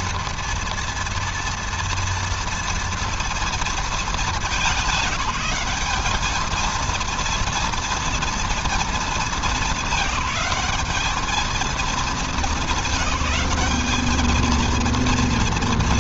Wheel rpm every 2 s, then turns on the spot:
230, 230, 210, 220, 230, 200, 200, 230.
none